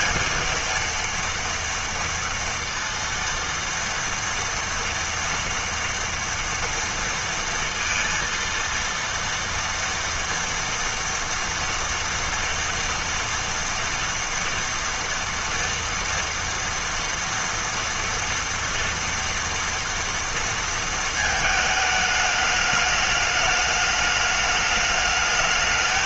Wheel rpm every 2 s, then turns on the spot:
230, 230, 230, 230, 230, 230, 230, 230, 230, 230, 230, 210, 210.
none